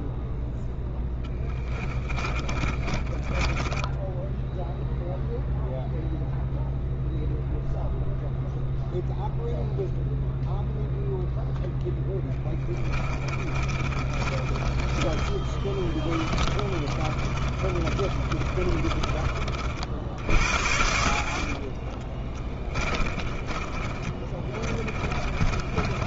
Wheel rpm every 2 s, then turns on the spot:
0, 20, 0, 0, 0, 0, 20, 20, 30, 20, 70, 30, 30.
2-4 12-14 16-26